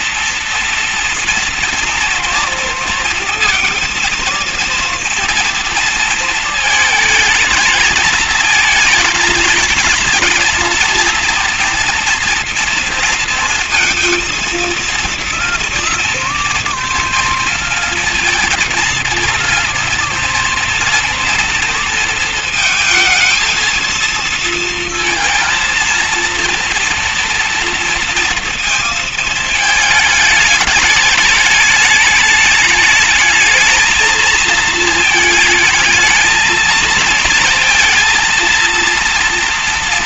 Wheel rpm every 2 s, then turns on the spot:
240, 240, 230, 220, 220, 240, 230, 220, 230, 230, 230, 230, 230, 230, 230, 220, 210, 220, 220, 230.
none